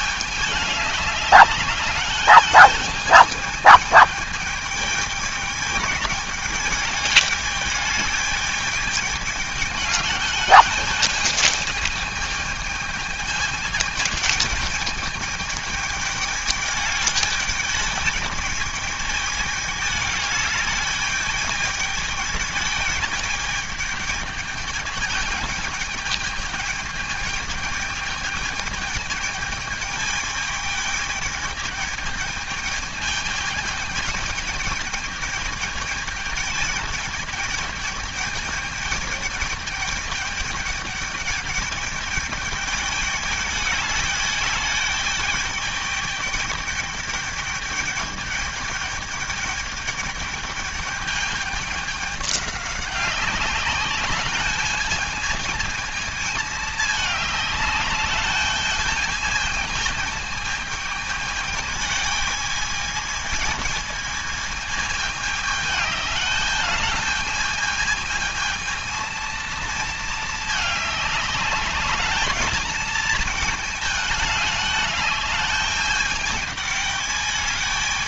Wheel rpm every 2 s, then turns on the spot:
210, 210, 210, 210, 210, 210, 210, 210, 210, 210, 210, 210, 210, 220, 220, 210, 220, 210, 210, 210, 210, 210, 210, 210, 210, 210, 200, 210, 210, 210, 220, 220, 220, 220, 230, 210, 220, 210, 210.
none